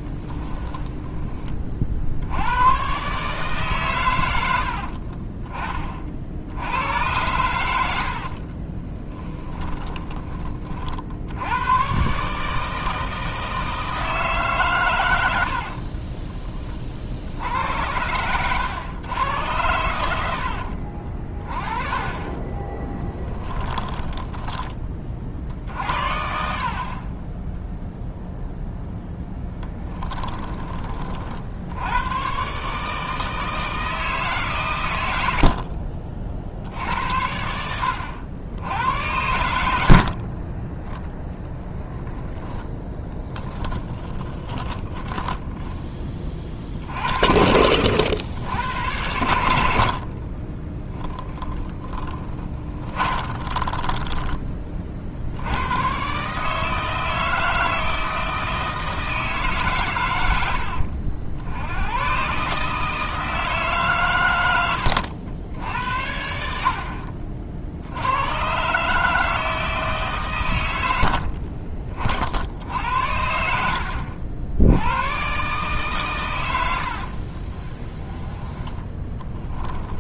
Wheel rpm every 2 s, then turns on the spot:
10, 120, 60, 90, 20, 50, 160, 130, 50, 110, 50, 10, 20, 40, 0, 30, 150, 110, 70, 100, 10, 10, 20, 60, 90, 10, 30, 50, 160, 160, 60, 160, 90, 60, 140, 90, 70, 80, 80, 20.
4-6 8-10 22-24 42-46 50-54 64-66 76-80